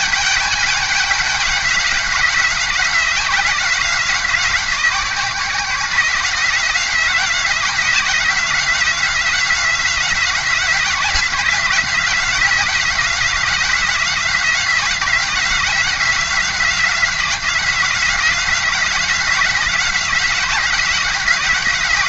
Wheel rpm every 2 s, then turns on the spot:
200, 180, 180, 170, 180, 180, 180, 180, 180, 180, 180.
none